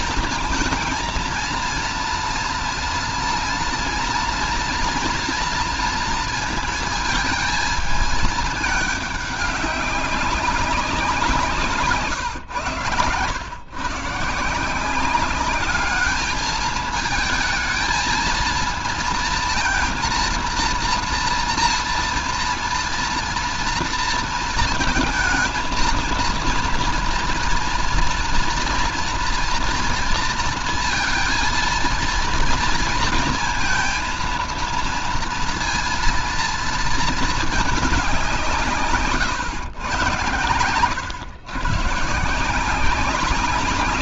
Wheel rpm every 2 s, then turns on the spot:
220, 230, 230, 230, 210, 190, 120, 170, 220, 230, 230, 230, 230, 230, 230, 230, 230, 230, 230, 160, 110, 170.
none